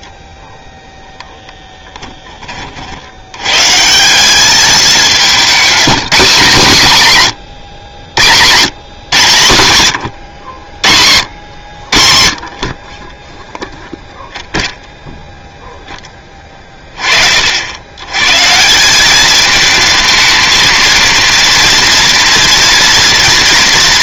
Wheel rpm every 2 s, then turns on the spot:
0, 20, 190, 220, 120, 90, 30, 0, 30, 180, 230, 230.
none